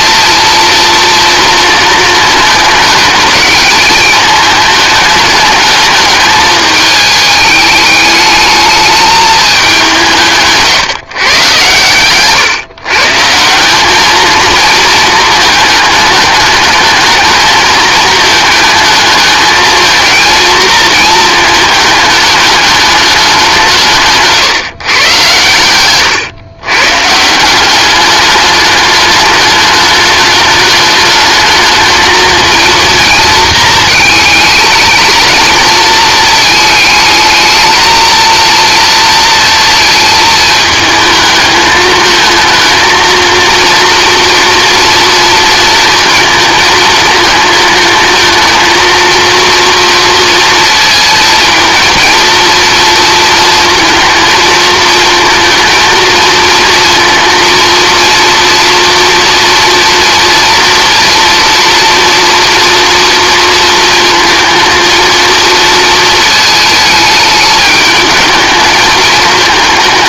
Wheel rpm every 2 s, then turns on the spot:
230, 210, 210, 220, 210, 160, 150, 220, 210, 220, 220, 210, 130, 130, 210, 210, 230, 220, 220, 230, 220, 230, 230, 220, 220, 220, 230, 230, 230, 230, 230, 230, 220, 210, 210.
none